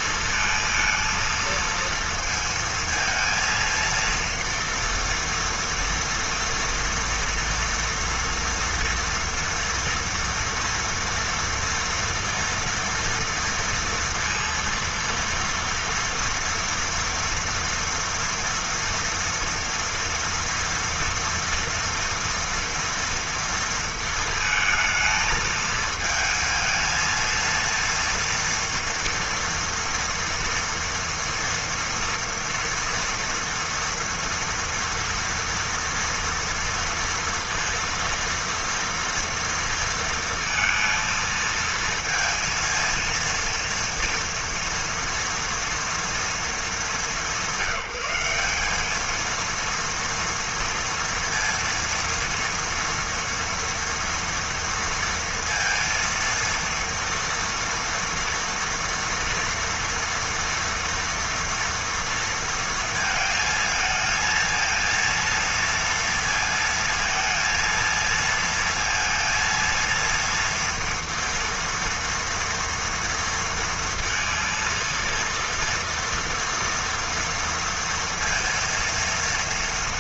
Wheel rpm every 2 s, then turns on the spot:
230, 230, 230, 230, 230, 230, 230, 230, 230, 230, 230, 230, 220, 220, 240, 230, 230, 230, 230, 230, 230, 230, 230, 230, 190, 230, 230, 230, 230, 230, 230, 230, 220, 230, 230, 230, 230, 230, 240, 230.
none